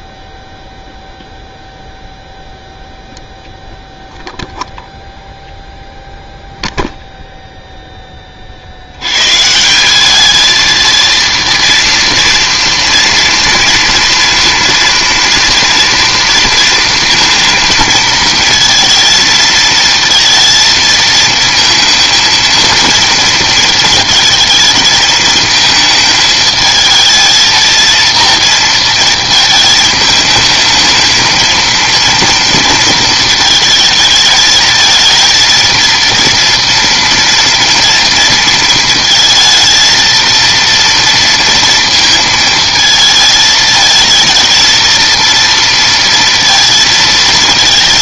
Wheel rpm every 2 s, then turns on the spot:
0, 0, 0, 0, 50, 220, 230, 230, 230, 230, 230, 230, 220, 220, 230, 220, 230, 220, 230, 230, 230, 230, 220, 230.
none